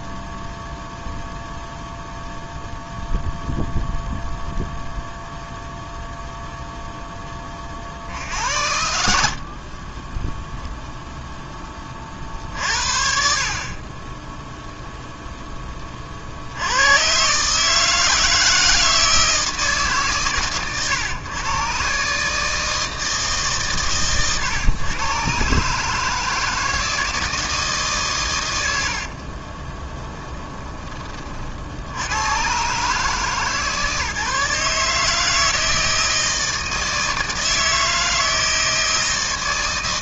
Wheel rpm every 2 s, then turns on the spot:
0, 0, 0, 0, 70, 0, 50, 0, 110, 160, 130, 160, 120, 160, 70, 20, 130, 150, 160, 160.
28-30